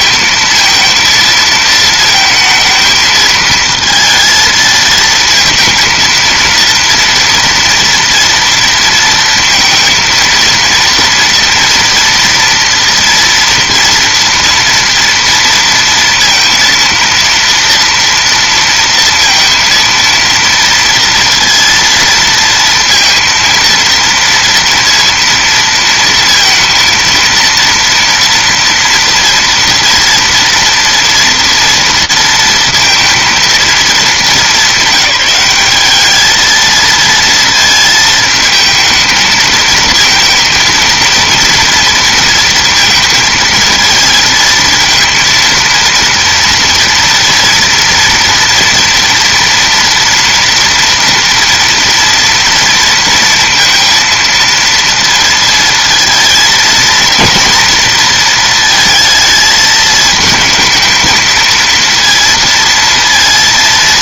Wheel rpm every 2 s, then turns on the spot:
230, 220, 220, 230, 230, 230, 230, 230, 230, 230, 230, 230, 230, 230, 230, 240, 230, 190, 220, 220, 230, 230, 230, 240, 230, 230, 230, 230, 220, 230, 220, 230.
none